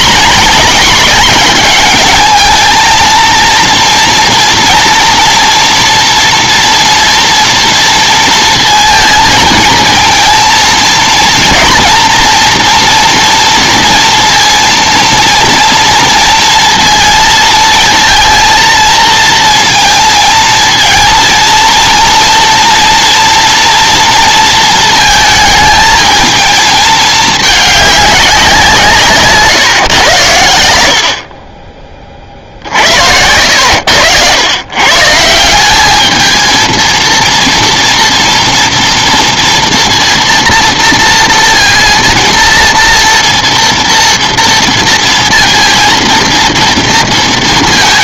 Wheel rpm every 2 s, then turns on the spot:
220, 220, 230, 230, 230, 230, 230, 230, 230, 230, 220, 230, 230, 220, 180, 100, 50, 120, 220, 230, 230, 230, 230, 230.
none